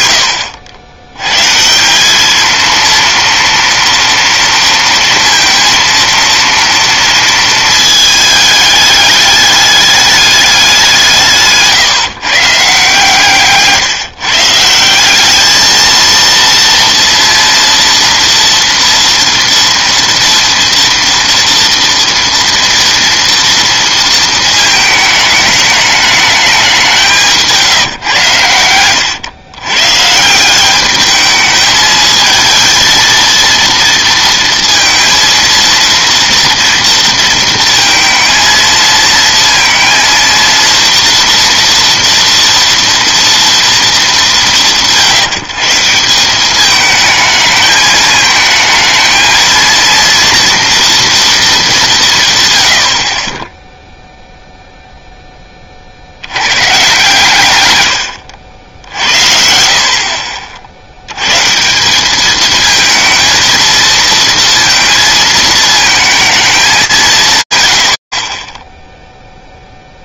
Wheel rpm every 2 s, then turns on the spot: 90, 230, 230, 230, 210, 150, 150, 210, 230, 230, 230, 230, 210, 160, 110, 210, 230, 230, 230, 230, 240, 230, 140, 220, 230, 230, 30, 20, 130, 60, 130, 220, 230, 150, 0.
26-28